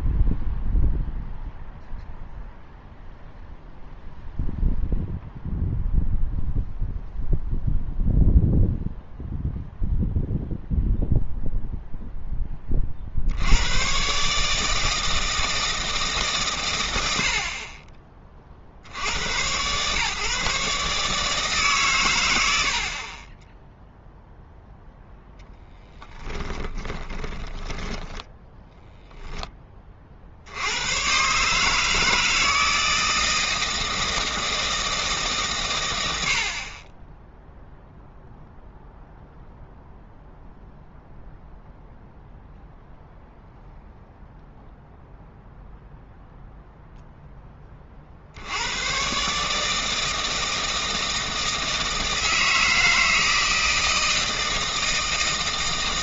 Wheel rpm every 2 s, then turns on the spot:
0, 0, 0, 0, 0, 0, 30, 160, 110, 70, 140, 70, 10, 20, 10, 100, 160, 160, 40, 0, 0, 0, 0, 0, 90, 160, 160, 160.
26-30